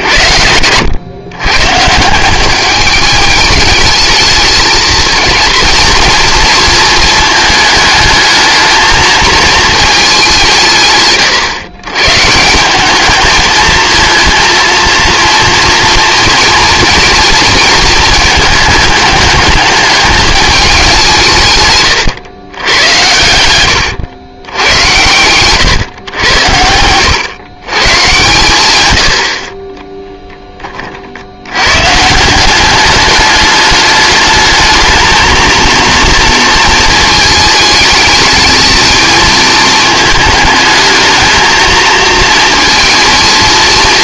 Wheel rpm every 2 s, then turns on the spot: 100, 200, 220, 230, 220, 150, 200, 230, 230, 210, 190, 90, 100, 90, 100, 40, 200, 220, 220, 220, 220, 230.
none